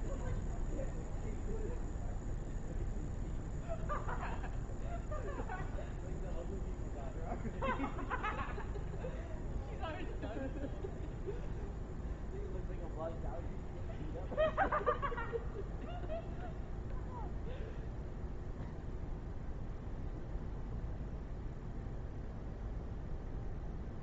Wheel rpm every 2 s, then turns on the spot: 0, 0, 0, 0, 0, 0, 0, 0, 0, 0, 0, 0.
none